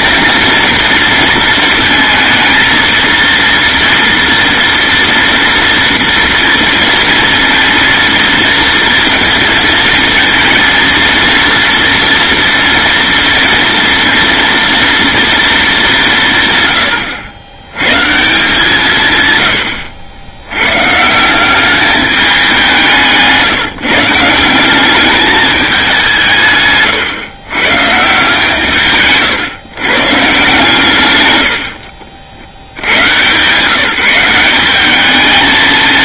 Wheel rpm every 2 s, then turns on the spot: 230, 230, 240, 230, 230, 230, 230, 230, 110, 150, 150, 170, 190, 130, 150, 140, 110, 200.
none